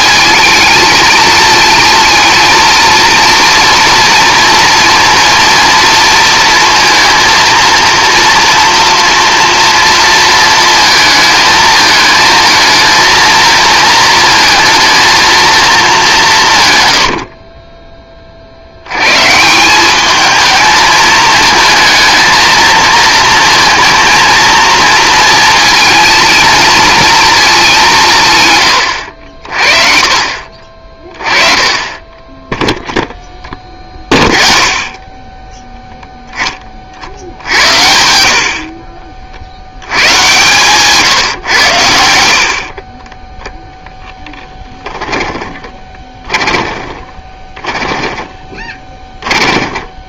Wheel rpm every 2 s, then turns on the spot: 220, 230, 230, 230, 230, 220, 220, 220, 130, 70, 220, 230, 230, 230, 130, 40, 10, 20, 30, 50, 120, 50, 10, 20, 10.
44-50